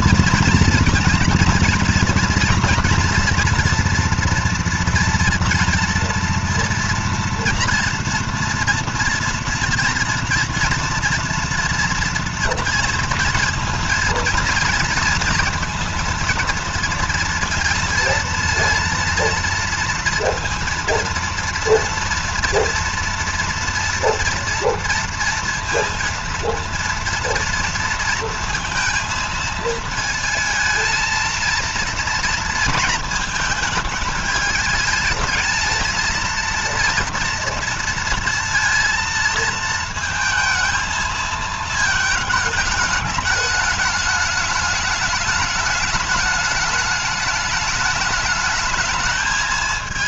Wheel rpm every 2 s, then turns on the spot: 230, 240, 240, 240, 230, 230, 230, 230, 230, 230, 230, 230, 230, 230, 230, 230, 230, 220, 230, 230, 220, 210, 210, 210, 210.
none